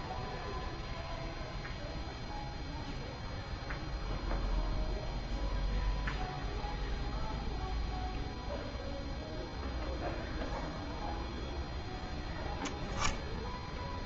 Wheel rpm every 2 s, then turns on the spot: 0, 0, 0, 0, 0, 0, 0.
none